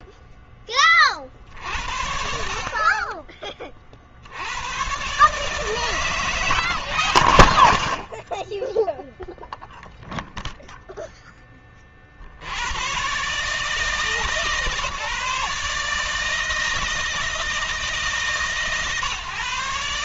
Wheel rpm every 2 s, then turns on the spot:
10, 50, 90, 140, 20, 0, 80, 150, 160, 140.
none